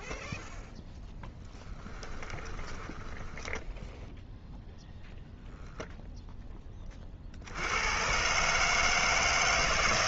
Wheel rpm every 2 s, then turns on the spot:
0, 10, 0, 10, 140.
2-4